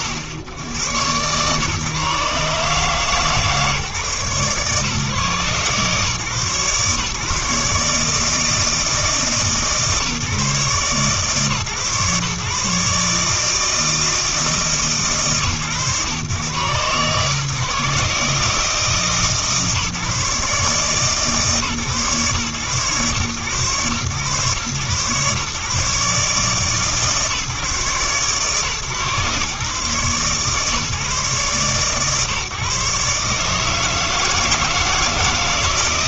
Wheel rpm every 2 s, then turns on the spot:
90, 140, 140, 140, 160, 140, 150, 150, 120, 160, 150, 120, 130, 150, 130, 140, 140, 160.
none